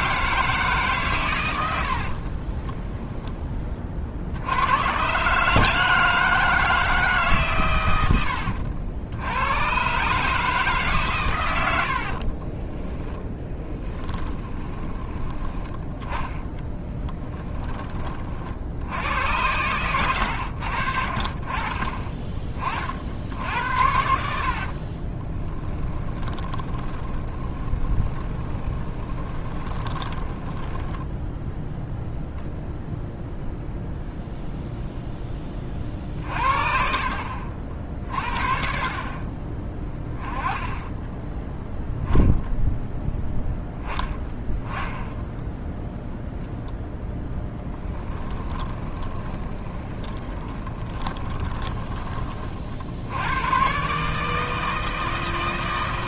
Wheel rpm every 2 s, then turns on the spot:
140, 20, 110, 160, 90, 150, 20, 20, 20, 80, 60, 50, 40, 20, 20, 10, 0, 0, 40, 40, 10, 0, 10, 0, 20, 20, 60, 160.
2-4 12-18 24-32 48-52